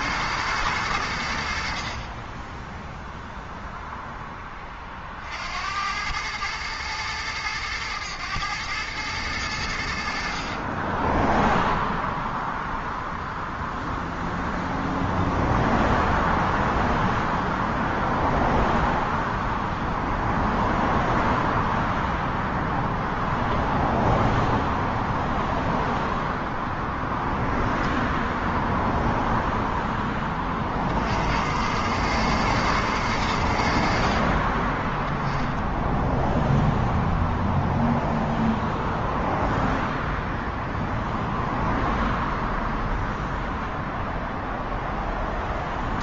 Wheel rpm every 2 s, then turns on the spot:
100, 0, 40, 110, 110, 30, 0, 0, 0, 0, 0, 0, 0, 0, 0, 50, 110, 20, 0, 0, 0, 0, 0.
none